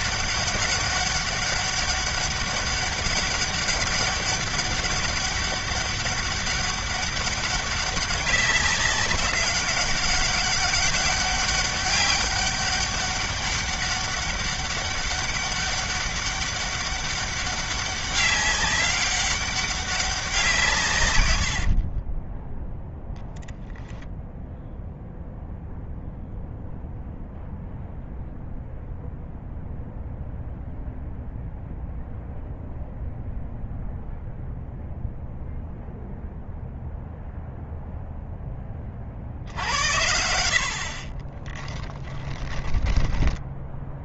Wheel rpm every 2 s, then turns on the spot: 200, 200, 200, 200, 190, 200, 200, 200, 200, 200, 140, 0, 0, 0, 0, 0, 0, 0, 0, 40, 60, 10.
40-42